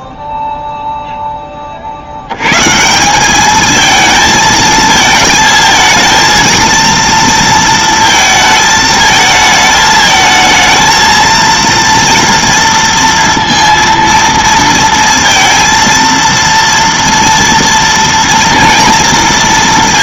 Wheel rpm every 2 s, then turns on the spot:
0, 160, 220, 230, 220, 220, 230, 230, 230, 230.
none